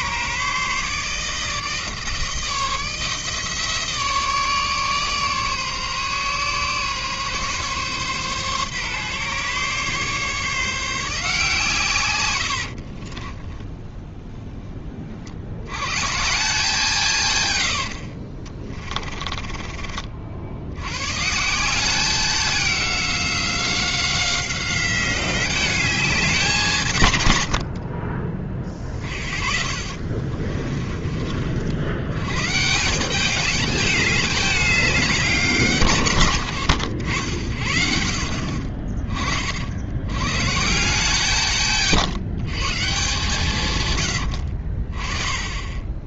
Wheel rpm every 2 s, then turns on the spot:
150, 160, 150, 140, 140, 160, 50, 30, 160, 30, 110, 190, 190, 160, 30, 30, 170, 200, 100, 40, 160, 150, 40.
12-14 18-20 28-32